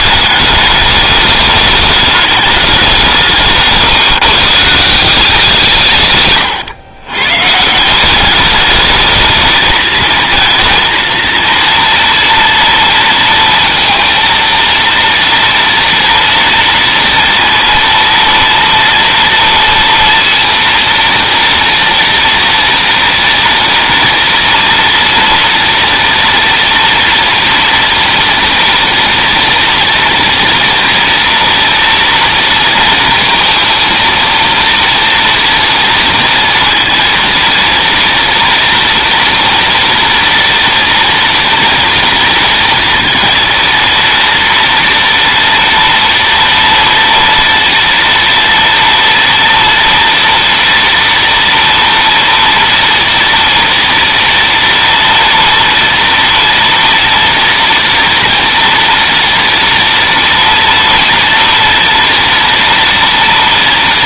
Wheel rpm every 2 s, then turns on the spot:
210, 210, 150, 130, 190, 220, 230, 230, 230, 230, 230, 230, 230, 230, 230, 240, 230, 230, 230, 240, 240, 230, 230, 230, 230, 230, 230, 230, 230, 230, 230, 230.
none